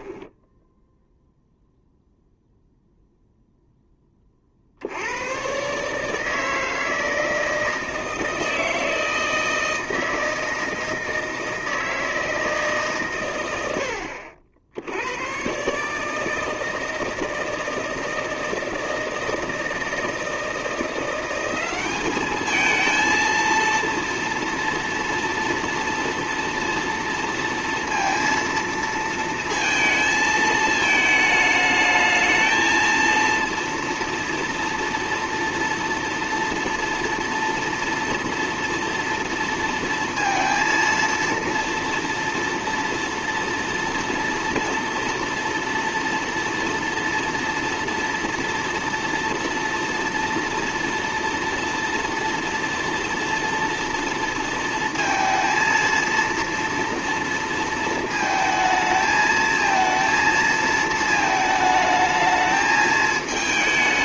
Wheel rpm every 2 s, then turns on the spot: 0, 0, 80, 160, 160, 160, 140, 90, 160, 160, 170, 220, 240, 230, 230, 220, 230, 230, 230, 230, 230, 230, 230, 230, 230, 230, 230, 230, 230, 220, 220, 220.
none